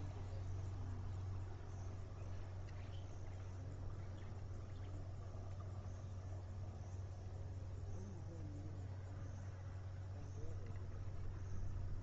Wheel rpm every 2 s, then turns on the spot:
0, 0, 0, 0, 0, 0.
none